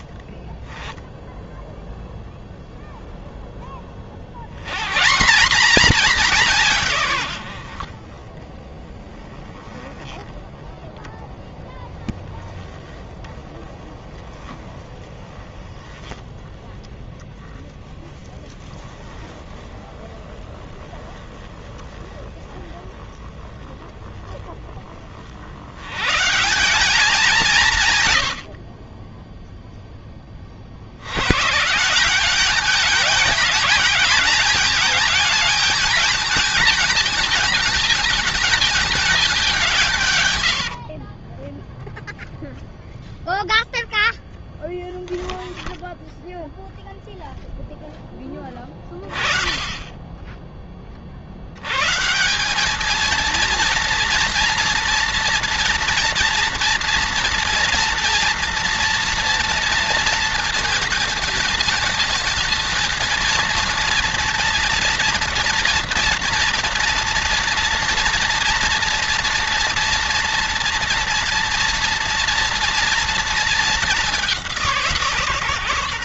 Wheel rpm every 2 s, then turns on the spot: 10, 0, 190, 100, 10, 10, 20, 30, 10, 10, 20, 10, 110, 120, 10, 170, 220, 220, 210, 150, 0, 0, 0, 0, 20, 90, 230, 230, 240, 230, 220, 230, 230, 240, 240, 230, 230, 130.
none